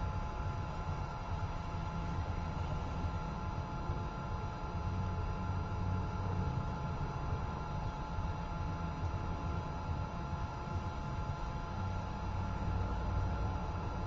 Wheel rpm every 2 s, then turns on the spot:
0, 0, 0, 0, 0, 0, 0.
none